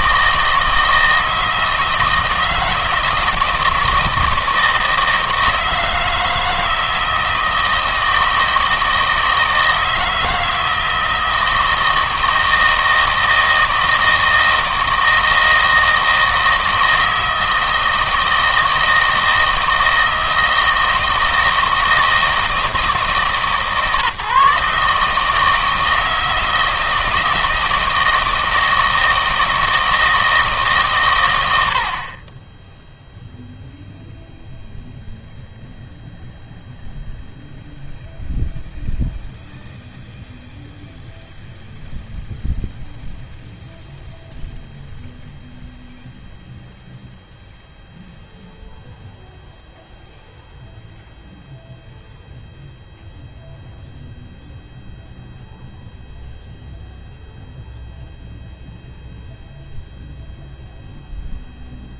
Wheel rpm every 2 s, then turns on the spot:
160, 160, 160, 160, 160, 160, 160, 160, 160, 160, 160, 160, 140, 160, 160, 140, 10, 0, 0, 0, 0, 0, 0, 0, 0, 0, 0, 0, 0, 0, 0.
none